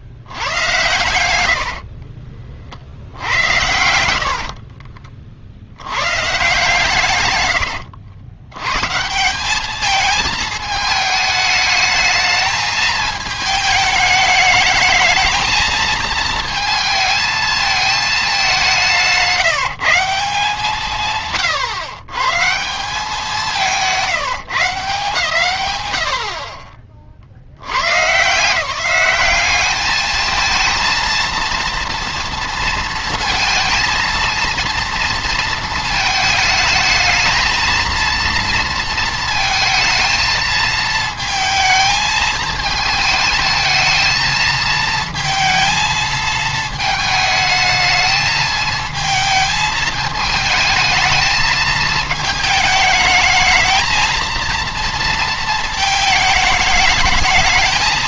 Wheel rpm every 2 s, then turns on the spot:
100, 60, 40, 130, 110, 220, 220, 220, 220, 180, 160, 170, 160, 40, 170, 230, 230, 230, 220, 230, 220, 220, 220, 220, 220, 220, 220, 230, 210.
0-2 4-6